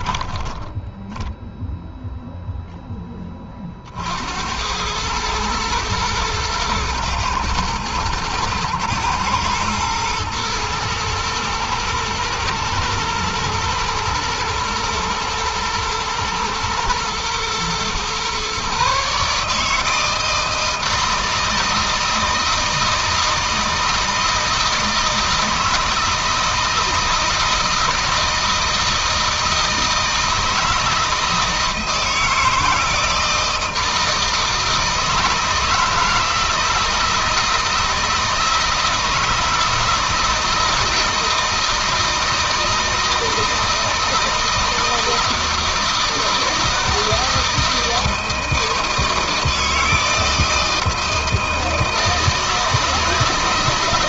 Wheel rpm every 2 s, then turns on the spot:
10, 10, 90, 110, 110, 110, 110, 120, 120, 140, 160, 160, 160, 160, 160, 160, 160, 160, 160, 160, 160, 160, 160, 160, 160, 160, 160.
0-2